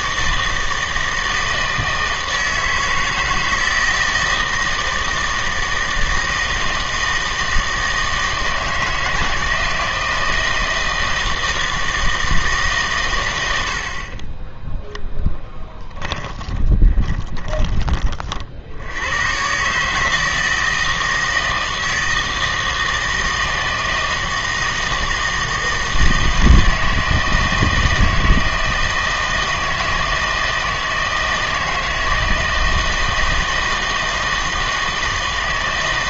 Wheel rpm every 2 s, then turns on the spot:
160, 160, 160, 160, 160, 160, 140, 10, 20, 70, 160, 160, 160, 160, 160, 160, 160, 160.
16-18